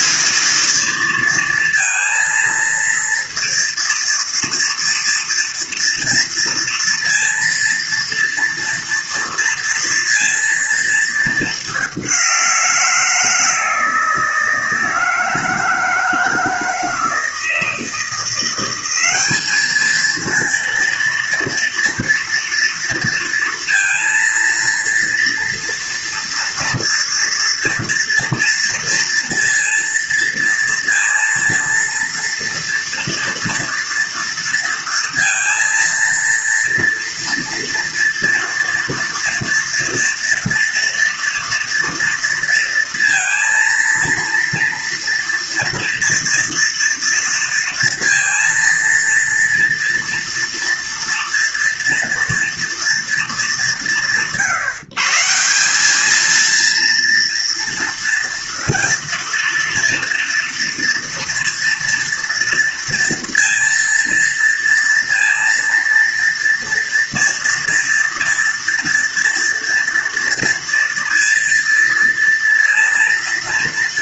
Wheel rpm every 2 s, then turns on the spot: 220, 230, 230, 230, 230, 230, 180, 160, 160, 180, 230, 230, 230, 240, 230, 230, 230, 230, 230, 230, 230, 230, 230, 230, 230, 230, 240, 140, 230, 230, 230, 230, 230, 230, 230, 230, 230.
none